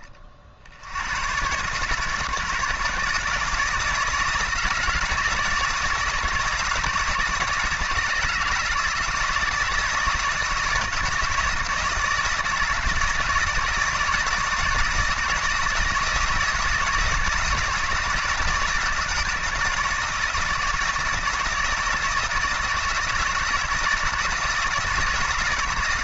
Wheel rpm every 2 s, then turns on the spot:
60, 160, 160, 160, 160, 160, 160, 160, 160, 170, 160, 160, 160.
none